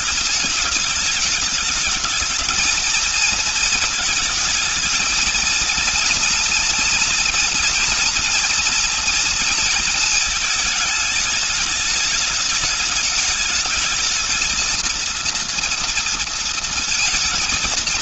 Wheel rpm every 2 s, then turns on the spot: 220, 220, 230, 240, 230, 220, 210, 230, 230.
none